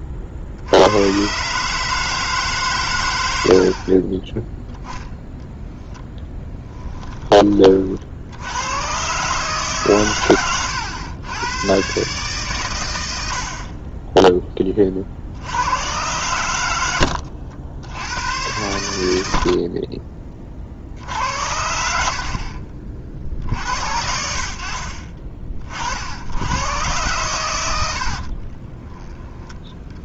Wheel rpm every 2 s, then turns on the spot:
90, 110, 10, 20, 110, 100, 110, 30, 90, 100, 50, 40, 40, 110, 20.
6-8 28-30